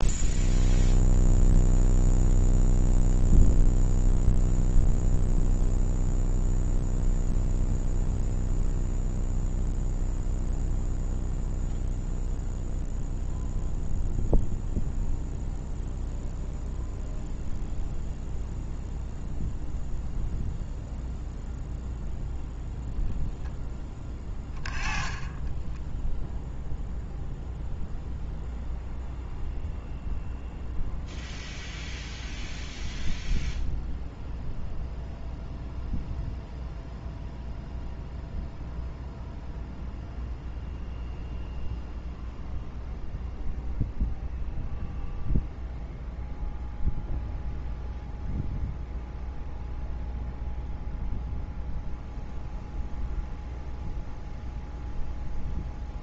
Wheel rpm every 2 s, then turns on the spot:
0, 0, 0, 0, 0, 0, 0, 0, 0, 0, 0, 0, 10, 0, 0, 0, 0, 0, 0, 0, 0, 0, 0, 0, 0, 0, 0, 0.
none